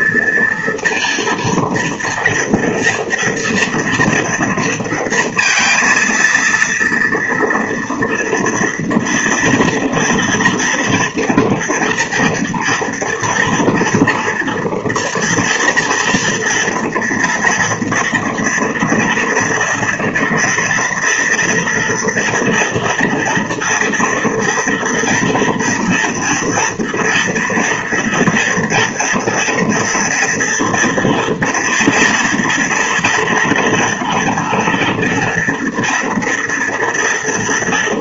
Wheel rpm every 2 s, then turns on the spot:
230, 230, 230, 230, 230, 230, 240, 230, 230, 230, 230, 230, 230, 230, 230, 230, 230, 230, 230.
none